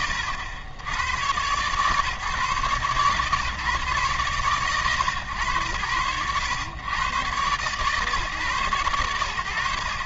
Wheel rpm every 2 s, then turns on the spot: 100, 140, 120, 110, 110.
none